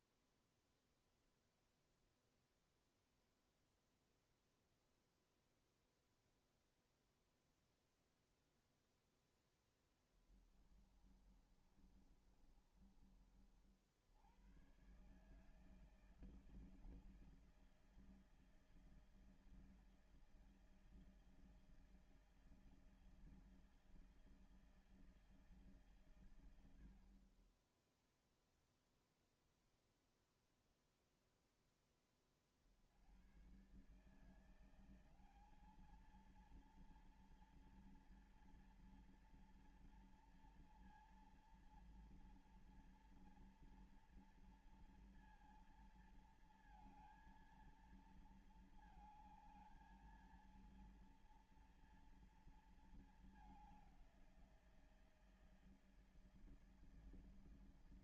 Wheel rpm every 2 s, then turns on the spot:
0, 0, 0, 0, 0, 10, 30, 70, 160, 160, 160, 160, 160, 130, 10, 0, 20, 140, 220, 230, 230, 230, 230, 230, 230, 220, 230, 190, 160.
10-14